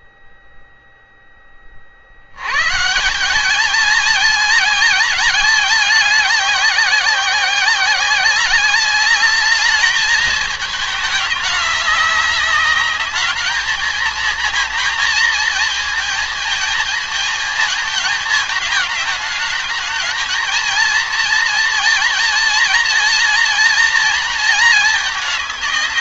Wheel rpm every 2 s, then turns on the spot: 10, 110, 220, 200, 200, 220, 200, 230, 230, 220, 220, 220, 220.
none